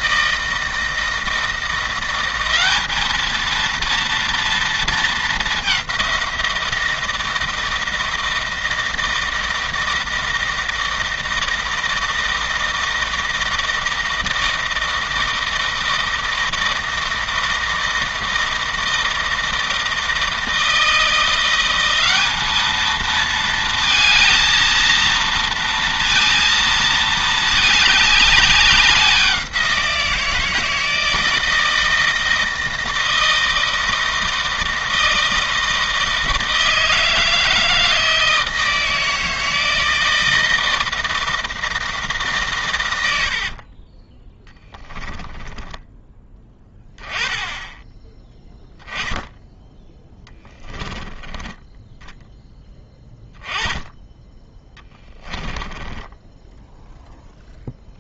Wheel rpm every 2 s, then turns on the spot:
160, 210, 220, 170, 160, 160, 160, 160, 160, 160, 170, 220, 230, 230, 190, 160, 160, 160, 160, 160, 160, 90, 10, 10, 0, 20, 10, 10, 0.
44-46 50-52